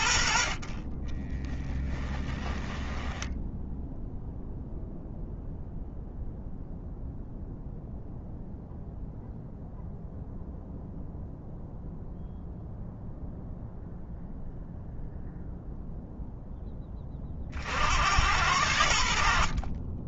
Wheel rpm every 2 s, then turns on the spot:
30, 10, 0, 0, 0, 0, 0, 0, 20, 80.
0-4